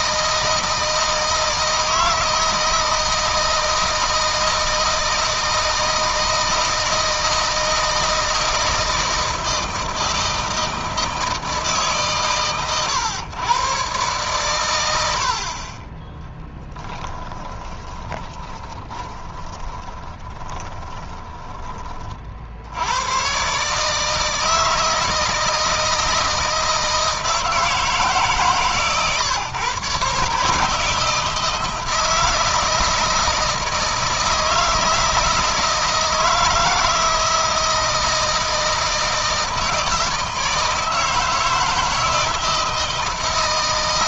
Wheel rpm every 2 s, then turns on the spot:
160, 160, 160, 160, 160, 160, 120, 100, 10, 20, 30, 90, 160, 160, 140, 150, 160, 160, 160, 160, 160, 160.
16-22